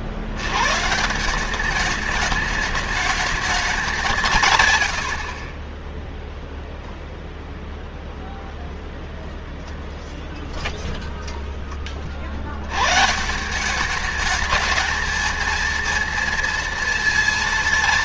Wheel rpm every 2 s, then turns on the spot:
160, 220, 100, 0, 0, 0, 120, 220, 230.
4-6